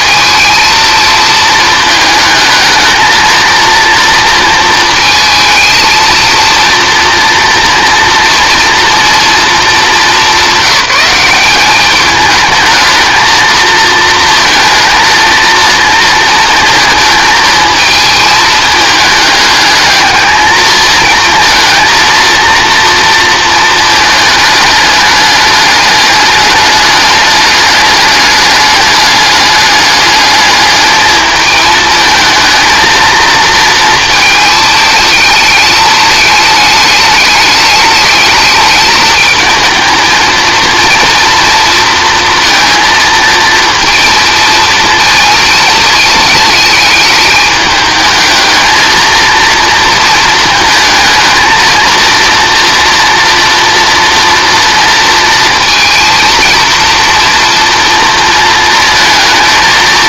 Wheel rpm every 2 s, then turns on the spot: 230, 220, 230, 230, 230, 190, 220, 230, 220, 220, 220, 230, 210, 210, 210, 210, 230, 220, 210, 210, 220, 230, 230, 210, 220, 220, 230, 230, 230, 230.
none